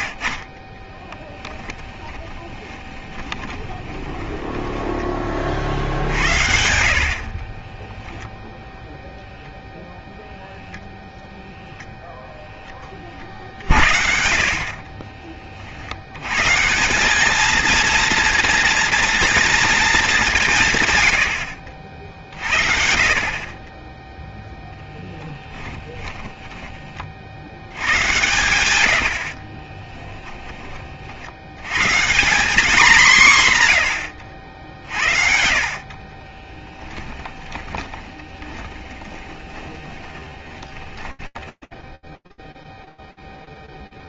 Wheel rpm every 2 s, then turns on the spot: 30, 20, 20, 70, 0, 0, 10, 50, 140, 230, 160, 50, 10, 20, 100, 20, 200, 70, 20, 30, 20, 0.
2-6 14-16 26-28 36-42